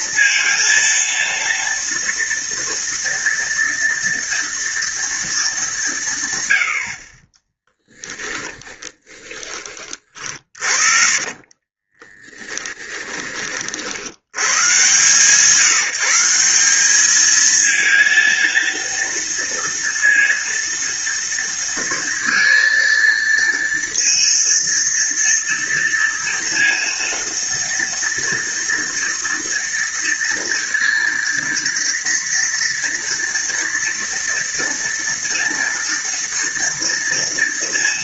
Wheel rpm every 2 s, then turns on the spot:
230, 230, 230, 140, 10, 40, 20, 100, 180, 230, 230, 230, 230, 230, 230, 230, 230, 230, 230.
8-14